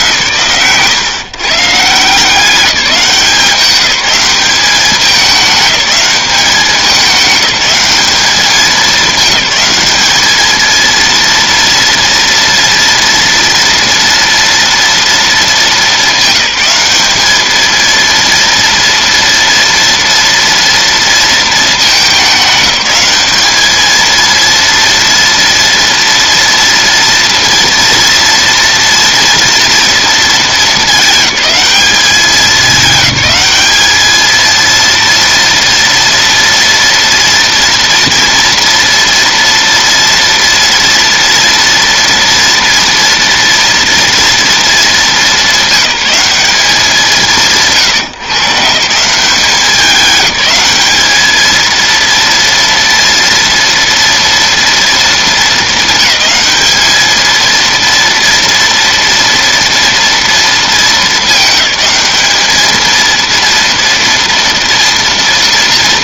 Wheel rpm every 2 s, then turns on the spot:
130, 190, 200, 200, 210, 220, 230, 230, 200, 230, 230, 190, 230, 230, 230, 220, 210, 230, 230, 230, 230, 230, 220, 190, 160, 210, 230, 230, 200, 230, 220, 220, 230.
none